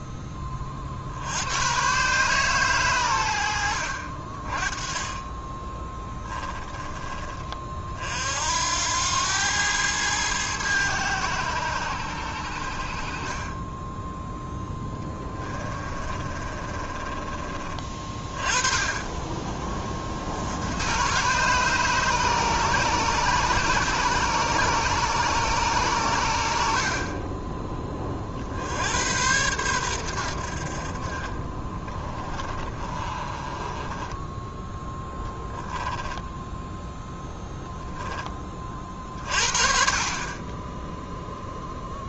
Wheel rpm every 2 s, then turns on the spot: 40, 110, 30, 20, 90, 100, 50, 10, 30, 30, 110, 140, 140, 50, 90, 40, 30, 0, 0, 40, 10.
14-18 32-34